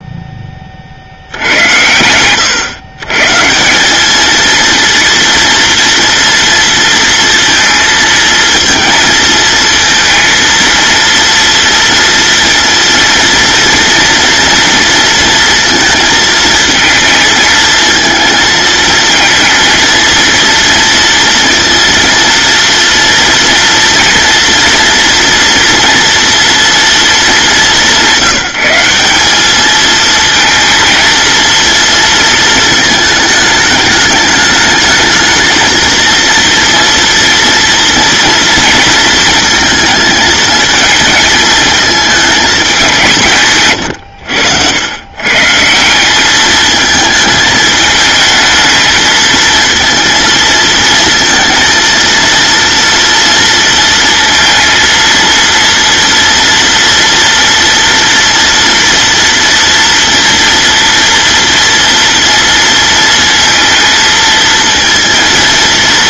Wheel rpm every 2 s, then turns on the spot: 80, 140, 230, 230, 230, 230, 230, 230, 220, 230, 230, 230, 240, 230, 190, 230, 210, 220, 230, 230, 220, 170, 120, 220, 220, 230, 230, 230, 230, 230, 230, 230, 230.
none